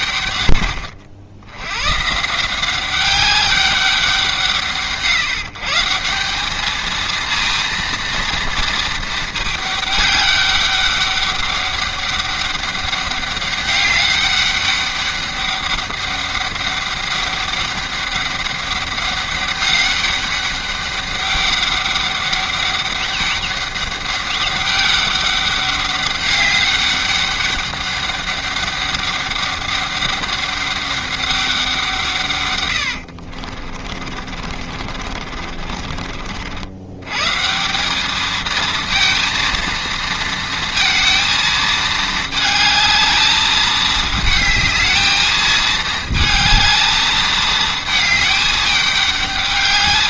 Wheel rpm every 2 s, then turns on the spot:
100, 180, 160, 210, 230, 200, 200, 200, 200, 200, 200, 200, 200, 200, 200, 200, 120, 50, 90, 220, 230, 220, 220, 220, 210.
32-36